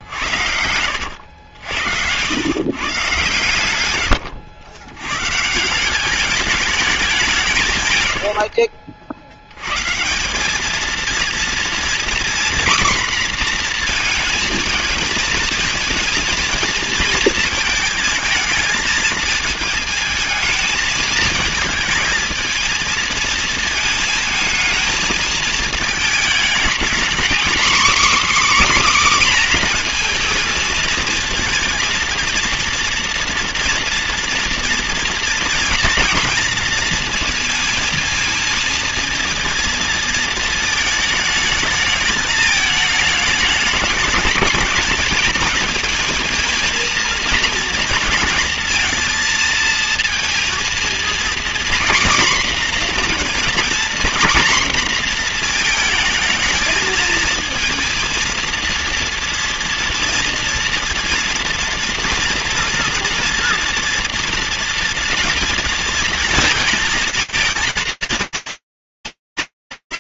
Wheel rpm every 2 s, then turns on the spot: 80, 130, 110, 200, 60, 230, 250, 220, 230, 220, 220, 220, 220, 240, 260, 220, 230, 230, 230, 230, 220, 210, 220, 230, 230, 230, 250, 240, 220, 230, 230, 230, 230, 230, 220.
0-2